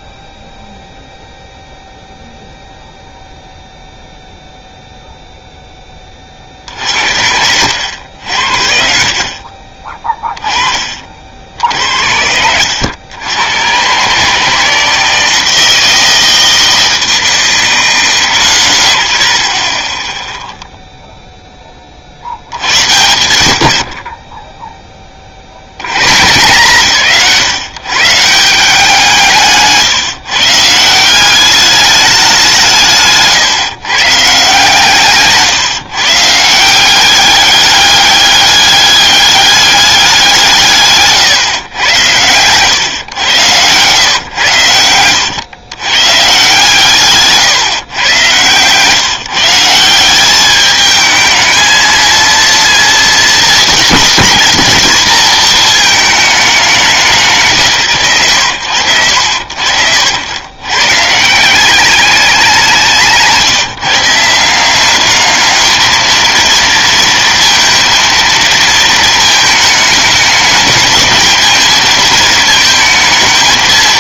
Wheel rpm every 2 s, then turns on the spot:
0, 0, 0, 70, 50, 40, 90, 160, 160, 90, 0, 90, 10, 150, 160, 180, 150, 150, 190, 200, 150, 110, 100, 140, 150, 220, 230, 220, 190, 70, 140, 170, 200, 230, 220, 220, 220.
32-34